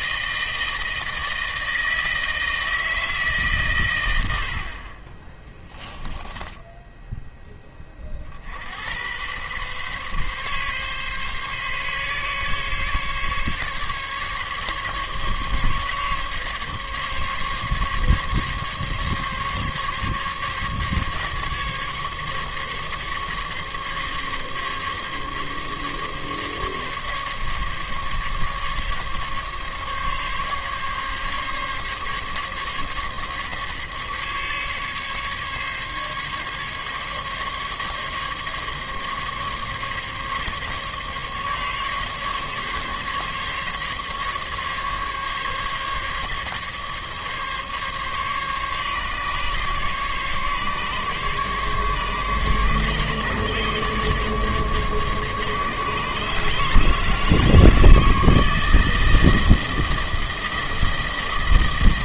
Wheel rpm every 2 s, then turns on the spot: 160, 160, 40, 10, 80, 140, 140, 140, 140, 140, 140, 140, 140, 140, 140, 140, 140, 140, 140, 140, 140, 140, 140, 140, 140, 140, 140, 140, 160, 160, 160.
6-8